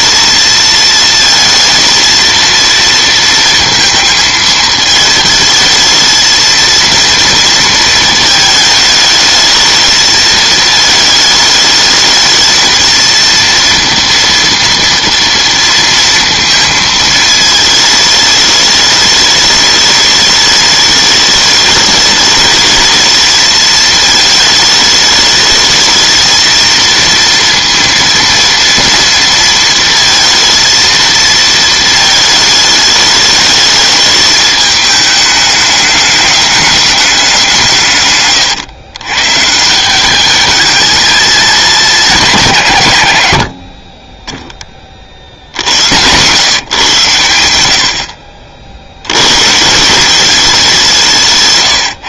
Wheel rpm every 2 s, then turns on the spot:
220, 230, 220, 230, 220, 220, 220, 230, 220, 210, 210, 220, 210, 230, 230, 230, 210, 210, 210, 120, 220, 140, 40, 140, 60, 180.
none